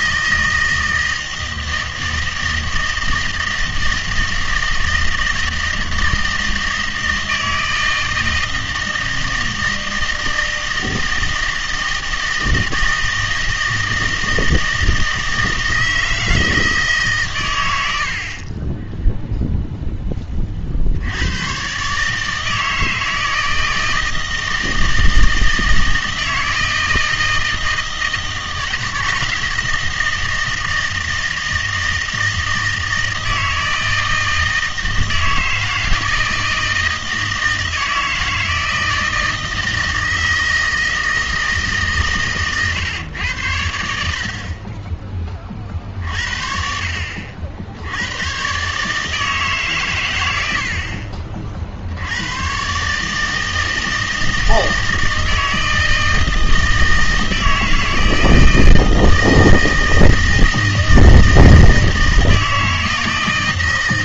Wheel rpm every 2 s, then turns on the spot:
160, 160, 160, 160, 160, 160, 160, 160, 160, 20, 50, 160, 160, 160, 160, 160, 160, 160, 160, 170, 160, 130, 30, 60, 130, 70, 120, 160, 160, 160, 160, 160.
none